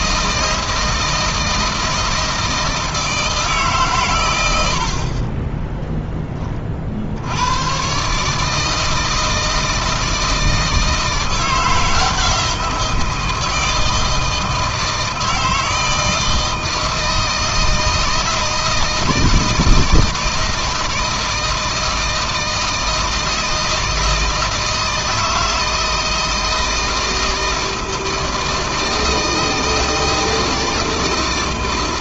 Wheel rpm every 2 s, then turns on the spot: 160, 160, 50, 60, 160, 160, 170, 160, 160, 160, 160, 160, 160, 160, 160, 160.
none